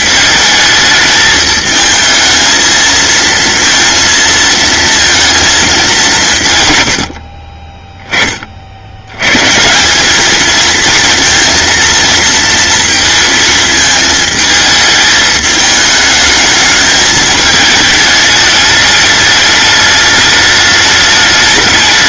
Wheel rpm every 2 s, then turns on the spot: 220, 230, 230, 100, 80, 230, 230, 220, 220, 210, 210.
none